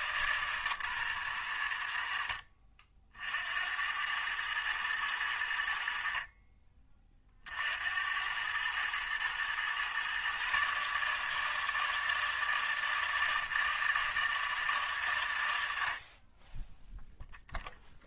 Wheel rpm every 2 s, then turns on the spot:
130, 60, 110, 30, 110, 140, 160, 150, 10.
none